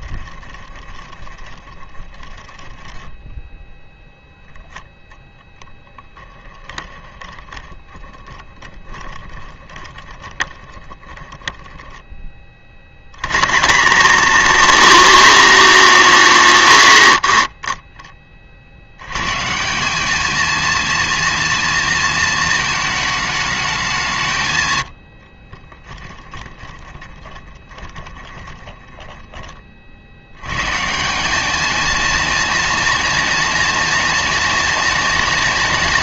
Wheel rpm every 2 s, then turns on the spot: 20, 10, 10, 10, 20, 10, 60, 240, 160, 80, 230, 220, 110, 30, 20, 140, 230, 230.
0-4 6-12 26-30